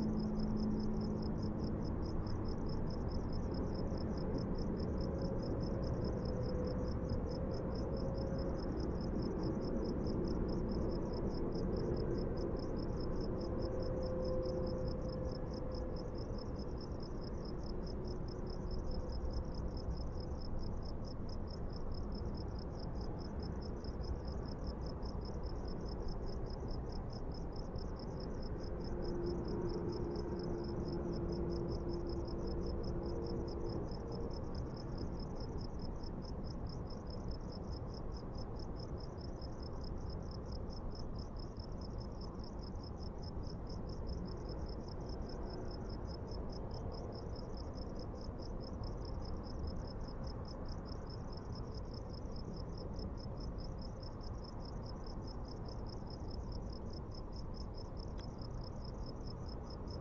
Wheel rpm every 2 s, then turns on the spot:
0, 0, 0, 0, 0, 0, 0, 0, 0, 0, 0, 0, 0, 0, 0, 0, 0, 0, 0, 0, 0, 0, 0, 0, 0, 0, 0, 0, 0, 0.
none